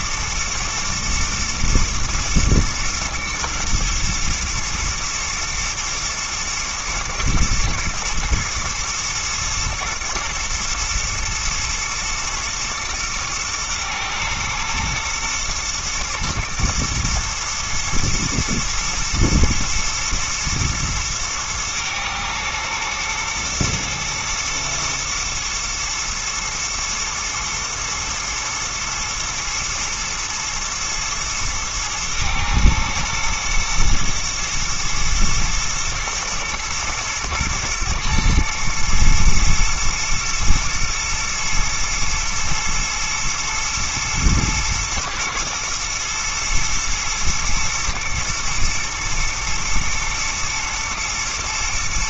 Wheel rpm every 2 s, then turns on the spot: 110, 120, 110, 120, 110, 110, 110, 120, 110, 110, 110, 110, 110, 120, 110, 110, 120, 110, 110, 110, 110, 110, 110, 110, 110, 110.
none